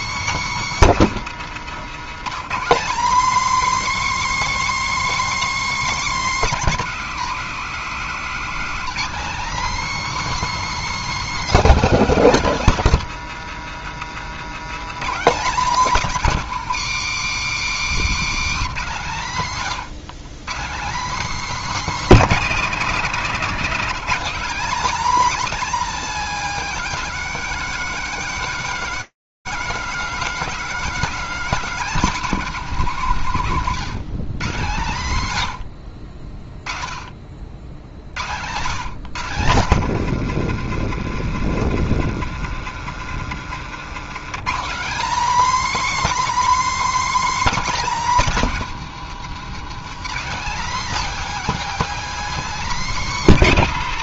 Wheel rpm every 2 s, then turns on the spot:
270, 210, 280, 240, 240, 310, 240, 200, 220, 190, 200, 260, 260, 280, 270, 270, 200, 130, 30, 140, 140, 140, 230, 310, 210, 260, 270.
none